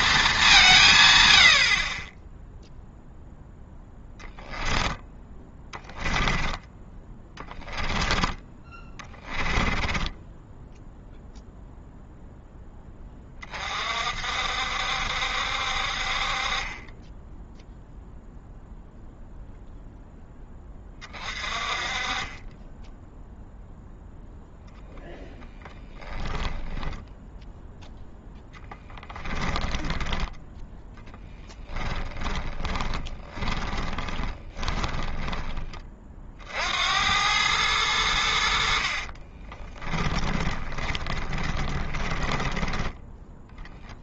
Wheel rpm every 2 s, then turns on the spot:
170, 0, 10, 20, 20, 10, 10, 60, 30, 0, 20, 10, 0, 10, 10, 10, 20, 20, 70, 70, 20, 10.
8-10 26-30 32-36 40-44